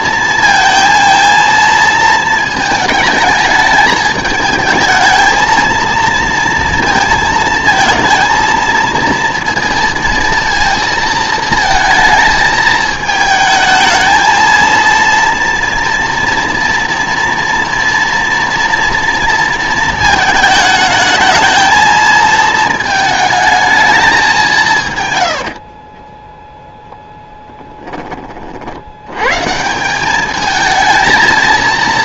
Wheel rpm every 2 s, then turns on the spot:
220, 220, 220, 230, 230, 230, 220, 230, 230, 230, 220, 220, 150, 0, 70, 220.
none